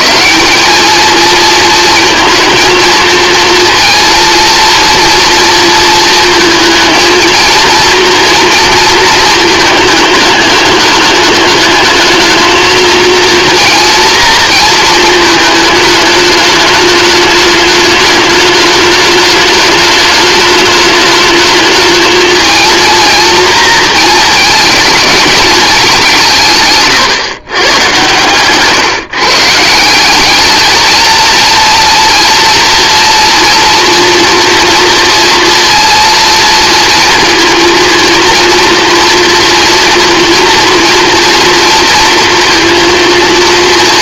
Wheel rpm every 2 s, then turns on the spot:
210, 230, 230, 220, 230, 210, 220, 230, 210, 210, 210, 230, 220, 140, 140, 220, 230, 230, 230, 230, 240, 230.
none